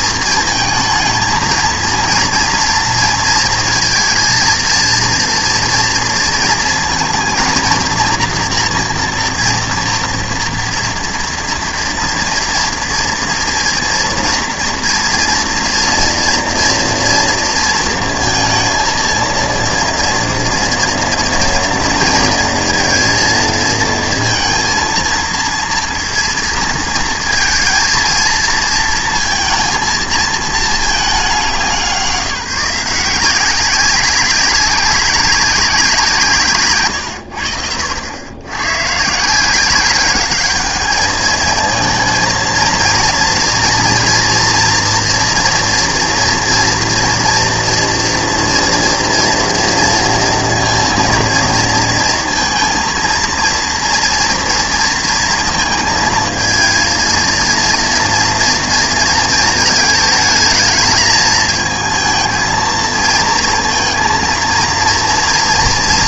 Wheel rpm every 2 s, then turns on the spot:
230, 240, 230, 230, 230, 230, 230, 230, 230, 230, 230, 230, 230, 230, 230, 230, 170, 190, 140, 100, 200, 230, 230, 230, 230, 230, 230, 230, 230, 230, 220, 220, 230.
none